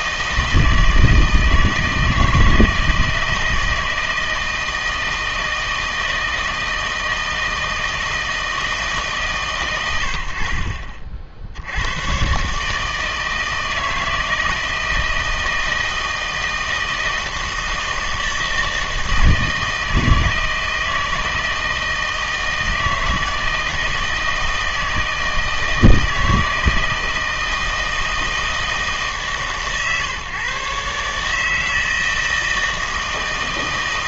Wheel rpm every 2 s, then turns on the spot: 160, 160, 160, 160, 160, 50, 150, 160, 160, 160, 160, 170, 160, 160, 160, 140, 160.
none